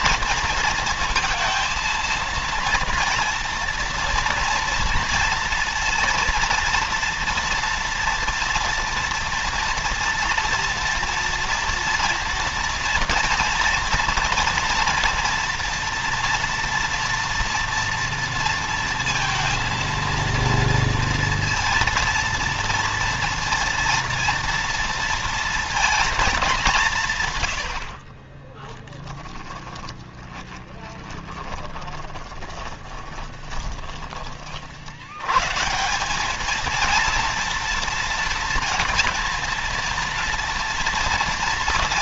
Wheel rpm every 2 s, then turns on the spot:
230, 230, 240, 230, 230, 230, 230, 230, 230, 230, 230, 230, 230, 230, 80, 20, 20, 20, 180, 230, 230.
28-34